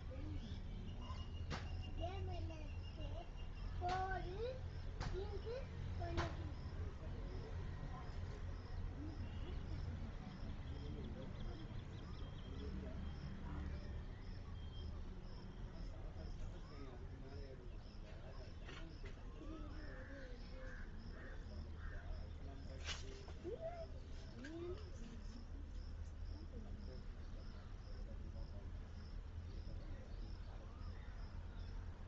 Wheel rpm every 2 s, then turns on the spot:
0, 0, 0, 0, 0, 0, 0, 0, 0, 0, 0, 0, 0, 0, 0, 0.
none